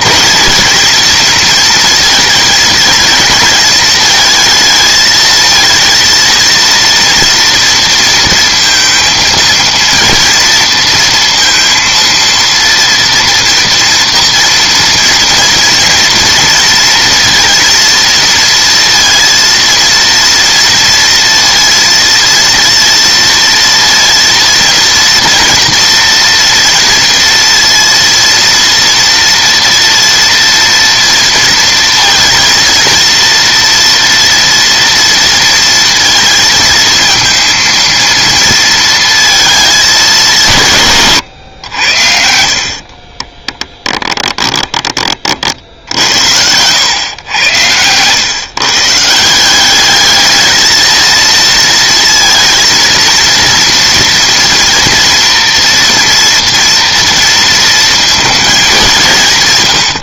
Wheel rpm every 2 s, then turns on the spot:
220, 230, 220, 230, 230, 230, 230, 230, 230, 230, 230, 230, 230, 230, 230, 230, 230, 230, 230, 230, 150, 70, 20, 100, 150, 220, 230, 240, 230, 200.
42-46